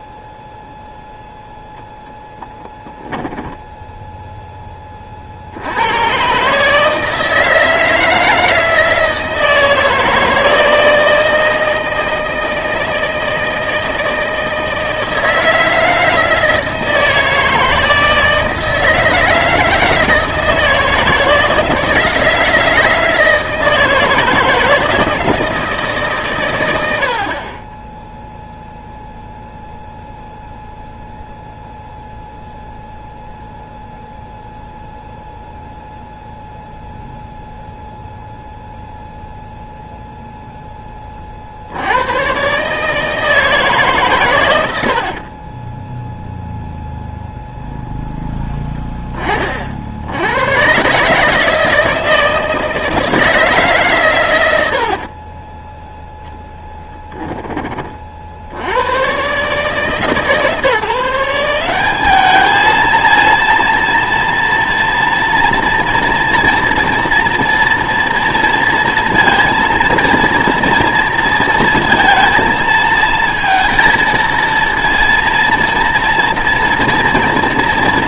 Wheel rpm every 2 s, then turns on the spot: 0, 0, 10, 150, 160, 160, 160, 160, 160, 160, 160, 160, 160, 100, 0, 0, 0, 0, 0, 0, 10, 140, 90, 0, 10, 120, 160, 80, 10, 80, 160, 220, 230, 230, 230, 230, 230, 230, 230.
44-46 54-58